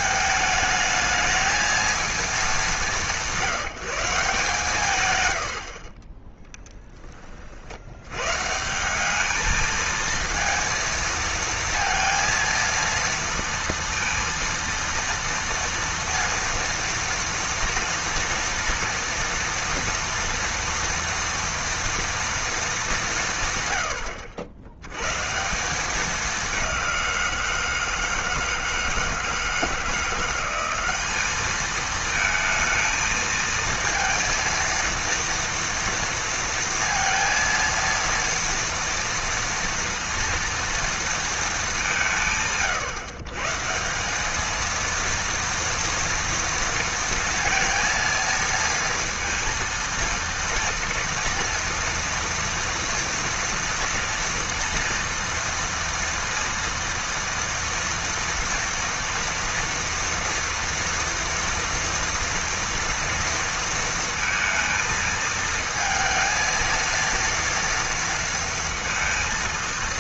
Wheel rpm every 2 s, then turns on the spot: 220, 200, 160, 20, 110, 230, 230, 230, 230, 230, 230, 230, 80, 200, 170, 170, 220, 230, 230, 230, 230, 170, 200, 230, 230, 230, 230, 230, 230, 230, 230, 230, 230, 230, 230.
none